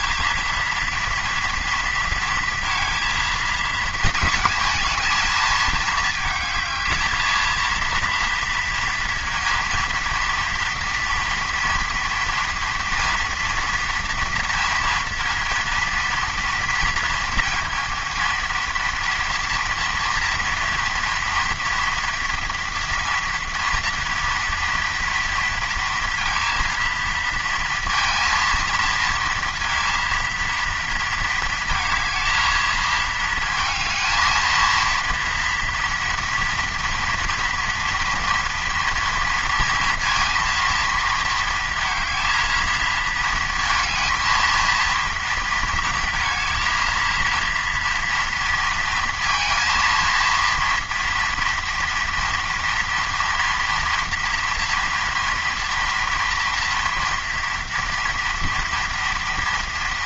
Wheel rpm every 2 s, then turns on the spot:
230, 230, 230, 220, 230, 230, 230, 230, 240, 230, 230, 230, 230, 230, 230, 230, 220, 230, 230, 230, 230, 220, 230, 230, 230, 230, 230, 230, 230, 230.
none